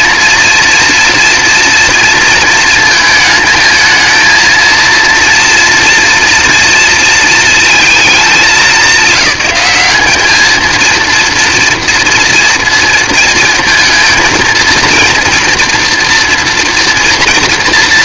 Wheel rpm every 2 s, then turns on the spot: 230, 220, 230, 230, 200, 230, 230, 230, 230.
none